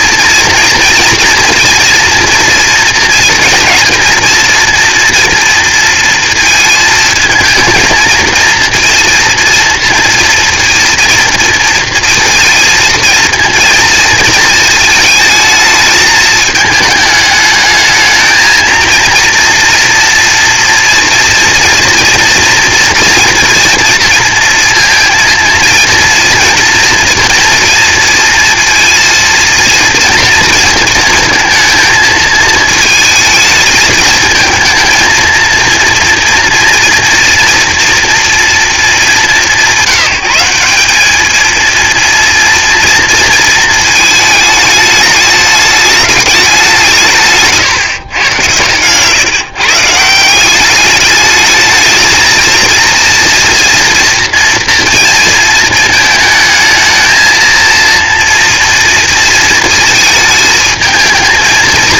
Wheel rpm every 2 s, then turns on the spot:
230, 230, 230, 230, 230, 230, 230, 220, 220, 230, 230, 240, 230, 230, 230, 230, 220, 220, 230, 220, 190, 230, 220, 180, 120, 200, 230, 230, 220, 230, 220.
none